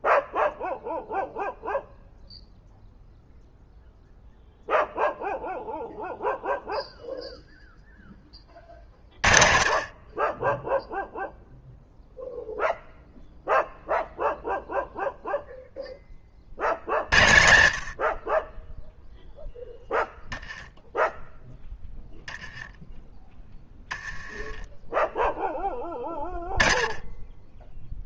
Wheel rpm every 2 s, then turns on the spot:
0, 0, 0, 0, 50, 0, 0, 0, 90, 10, 10, 10, 10, 10.
none